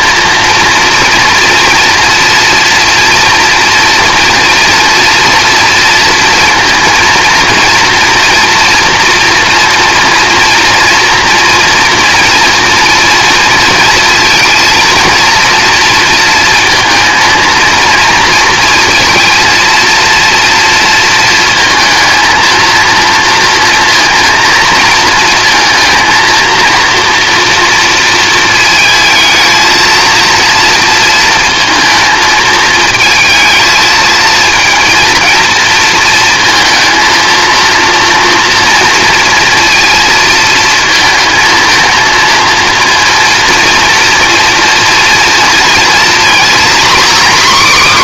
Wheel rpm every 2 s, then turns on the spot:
230, 230, 230, 230, 240, 230, 240, 230, 230, 230, 230, 230, 230, 230, 230, 230, 220, 230, 230, 230, 230, 230, 230, 260.
none